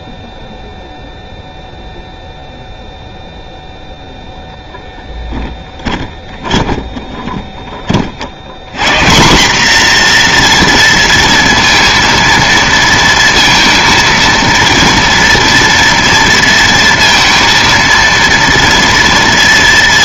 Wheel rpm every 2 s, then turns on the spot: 0, 0, 0, 10, 150, 230, 230, 230, 230, 230.
6-8